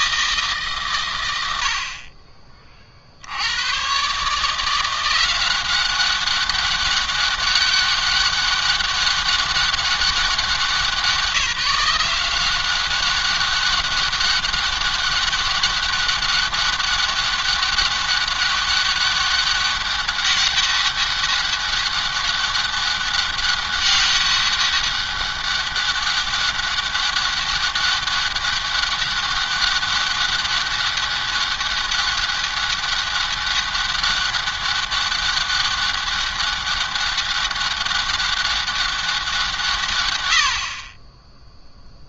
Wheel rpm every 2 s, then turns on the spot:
130, 50, 170, 200, 200, 190, 190, 200, 200, 200, 200, 200, 200, 200, 200, 200, 200, 200, 200, 190, 40.
none